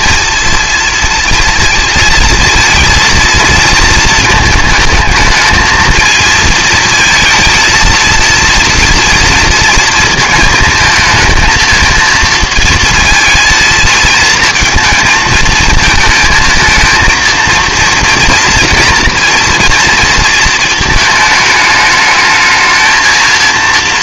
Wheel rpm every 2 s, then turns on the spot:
230, 230, 220, 230, 230, 220, 230, 220, 220, 230, 220, 210.
none